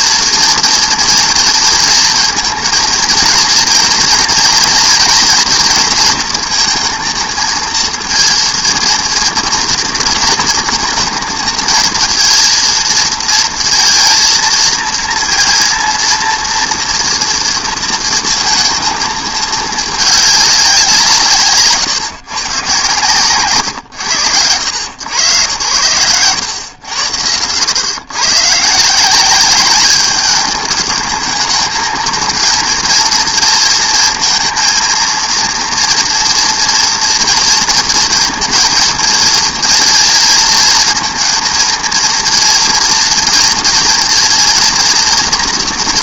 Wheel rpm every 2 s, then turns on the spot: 230, 230, 230, 230, 230, 230, 230, 230, 230, 230, 190, 130, 90, 100, 140, 210, 230, 230, 240, 230, 230, 230, 230.
none